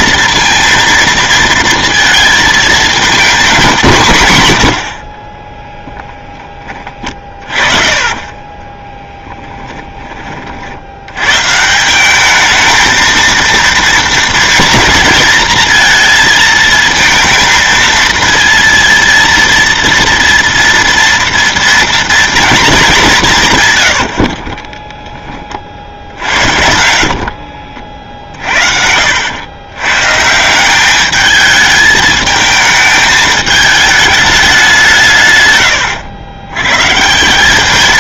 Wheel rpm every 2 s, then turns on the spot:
230, 220, 120, 20, 20, 50, 220, 230, 220, 230, 240, 220, 40, 60, 60, 180, 220, 200, 100.
4-10 24-26